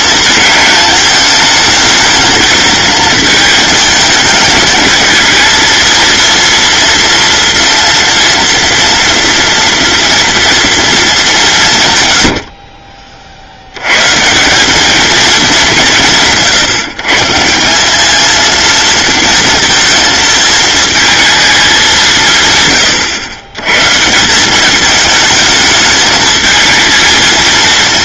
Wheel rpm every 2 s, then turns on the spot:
220, 220, 220, 240, 240, 230, 40, 200, 150, 230, 220, 130, 210, 220.
none